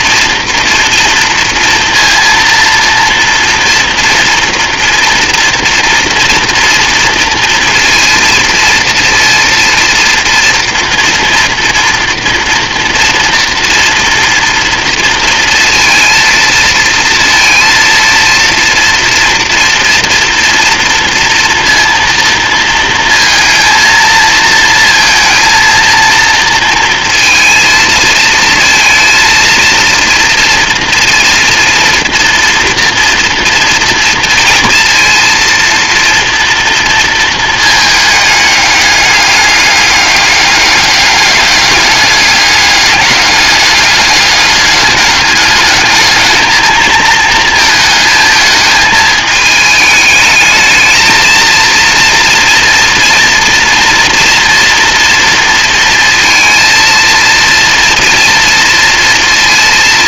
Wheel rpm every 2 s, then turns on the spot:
230, 230, 240, 230, 230, 240, 230, 230, 230, 230, 240, 230, 230, 230, 230, 230, 230, 230, 230, 210, 200, 200, 200, 220, 220, 220, 230, 230, 230, 230.
none